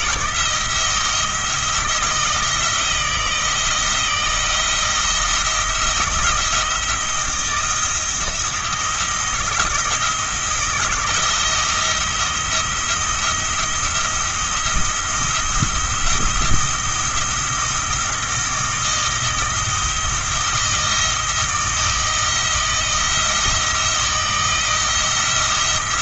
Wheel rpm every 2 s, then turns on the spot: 170, 170, 170, 170, 170, 170, 170, 170, 170, 170, 170, 170, 170.
none